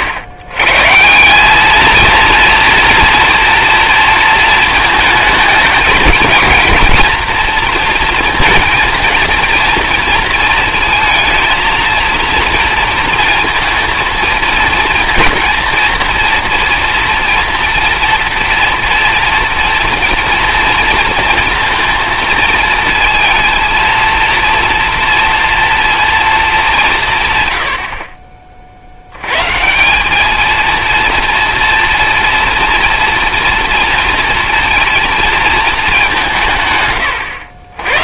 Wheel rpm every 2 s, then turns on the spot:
130, 230, 220, 230, 230, 230, 230, 230, 230, 240, 230, 220, 230, 200, 60, 230, 230, 230, 140.
none